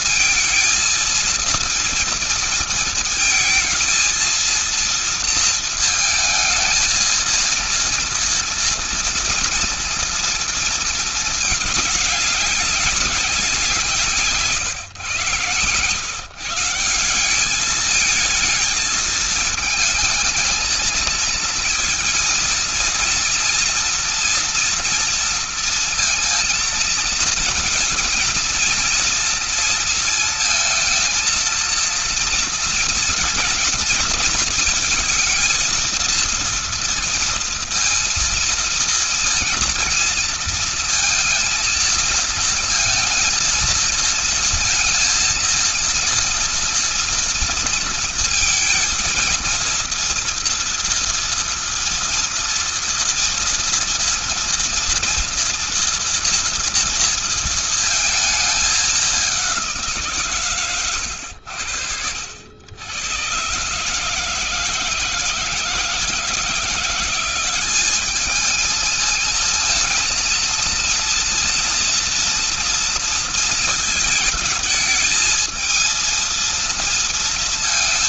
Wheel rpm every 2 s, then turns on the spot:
230, 230, 230, 220, 230, 230, 200, 160, 130, 220, 220, 230, 230, 230, 230, 230, 230, 230, 230, 230, 230, 230, 230, 230, 230, 230, 230, 230, 230, 220, 150, 90, 160, 160, 210, 230, 230, 220, 230.
none